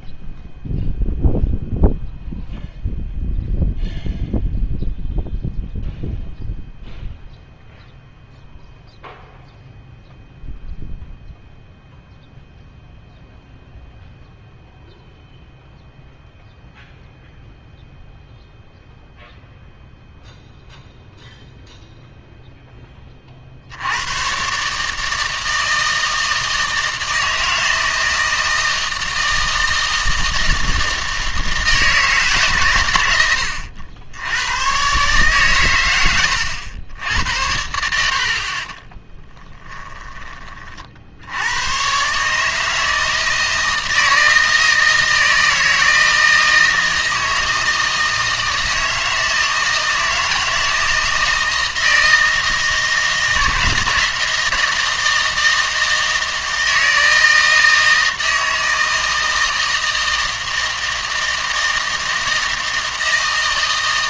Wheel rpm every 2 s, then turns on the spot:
0, 0, 0, 0, 0, 0, 0, 0, 0, 0, 0, 10, 150, 160, 160, 160, 120, 130, 90, 30, 40, 160, 160, 160, 160, 160, 160, 160, 160, 160, 160, 160.
38-40